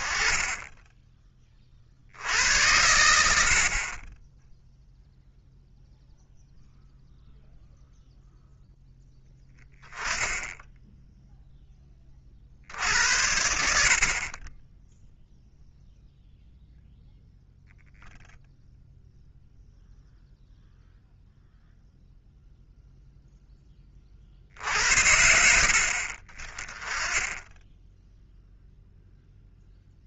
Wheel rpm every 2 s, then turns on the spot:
10, 90, 0, 0, 0, 10, 60, 0, 0, 0, 0, 0, 60, 10, 0.
none